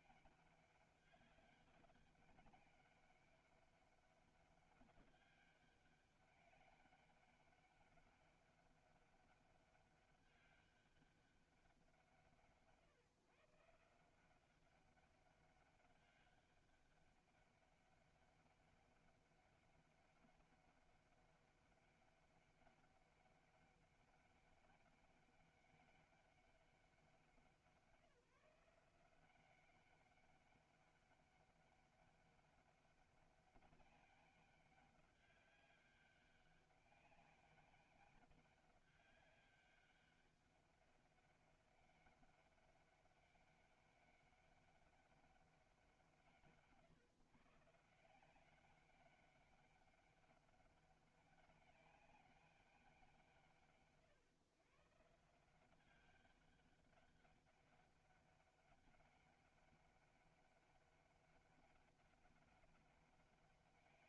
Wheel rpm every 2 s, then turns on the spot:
200, 200, 200, 200, 200, 200, 150, 190, 200, 200, 200, 200, 200, 200, 170, 200, 200, 200, 200, 200, 200, 200, 200, 140, 190, 200, 200, 130, 200, 200, 200, 200.
none